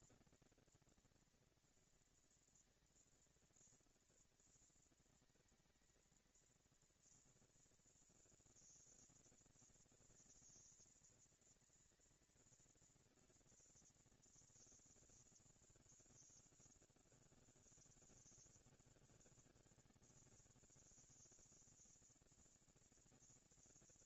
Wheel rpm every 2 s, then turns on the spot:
230, 230, 230, 220, 230, 230, 230, 230, 180, 160, 170, 200.
none